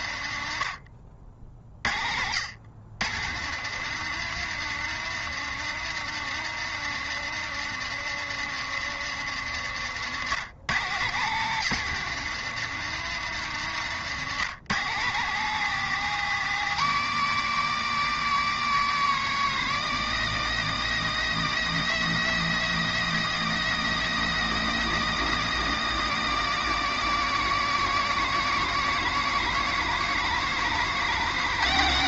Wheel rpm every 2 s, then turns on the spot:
60, 120, 160, 160, 140, 130, 150, 150, 170, 170, 180, 180, 180, 170, 170, 190.
none